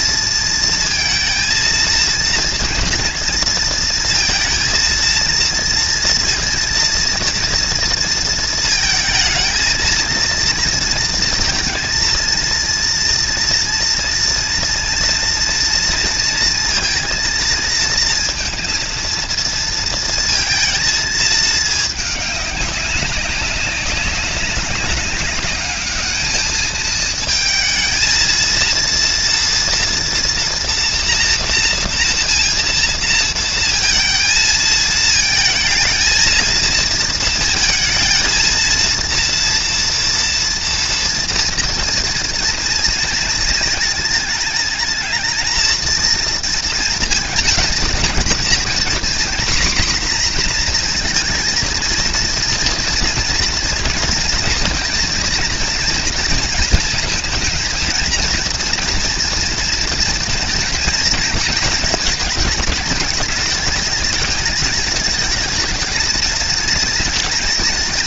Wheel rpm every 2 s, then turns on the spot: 230, 230, 230, 230, 230, 230, 230, 230, 230, 230, 230, 200, 200, 220, 230, 240, 230, 220, 230, 230, 230, 220, 220, 230, 230, 240, 230, 230, 230, 230, 230, 210, 210, 220.
none